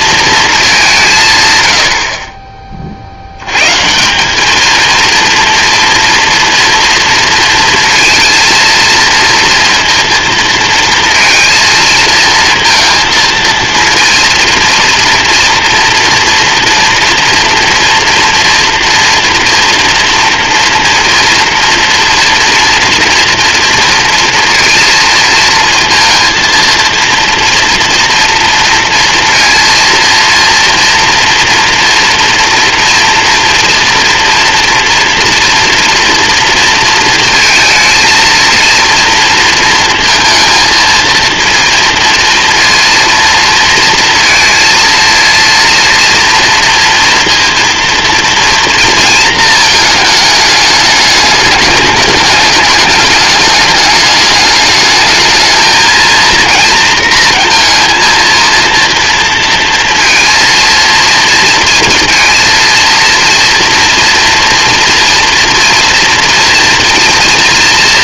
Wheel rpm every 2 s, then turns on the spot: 160, 70, 230, 230, 230, 230, 220, 230, 240, 240, 240, 230, 230, 230, 230, 230, 230, 240, 230, 230, 220, 230, 230, 230, 220, 210, 210, 220, 230, 230, 230, 230, 230, 230.
none